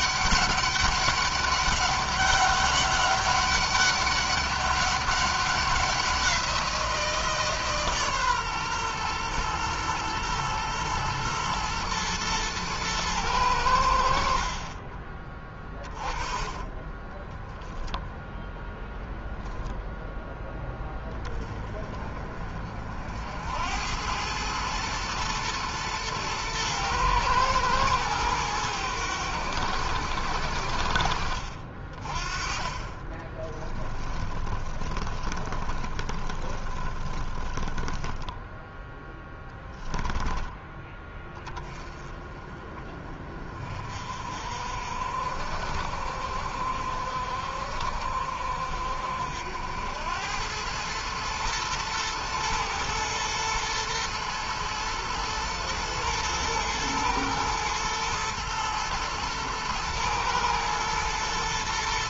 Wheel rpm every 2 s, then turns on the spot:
200, 200, 200, 170, 130, 120, 110, 30, 20, 0, 10, 50, 110, 120, 100, 60, 20, 20, 20, 0, 10, 30, 60, 60, 60, 100, 110, 110, 110, 110, 110.
32-38